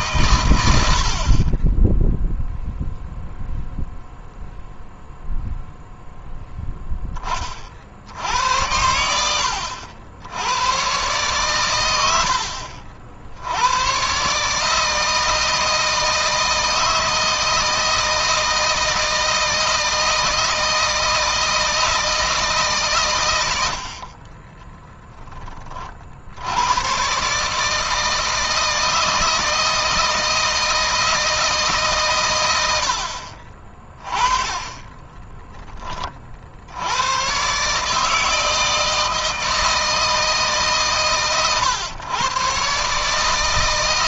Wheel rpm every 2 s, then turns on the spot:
80, 0, 0, 10, 90, 120, 70, 160, 160, 160, 160, 130, 10, 110, 160, 160, 60, 20, 90, 160, 130, 140.
0-2 34-36